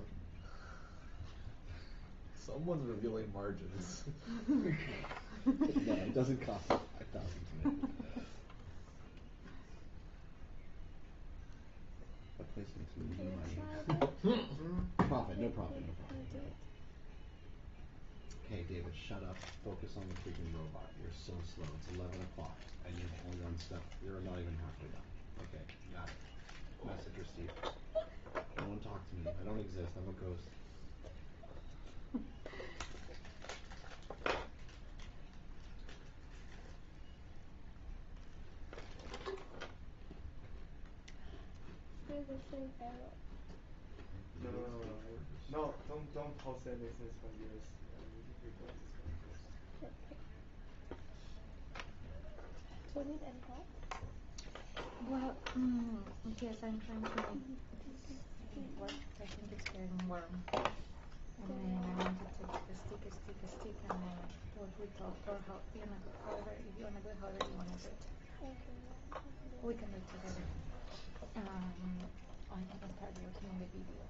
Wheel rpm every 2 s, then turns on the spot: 0, 0, 0, 0, 0, 0, 0, 0, 0, 0, 0, 0, 0, 0, 0, 0, 0, 0, 0, 0, 0, 0, 0, 0, 0, 0, 0, 0, 0, 0, 0, 0, 0, 0, 0, 0, 0.
none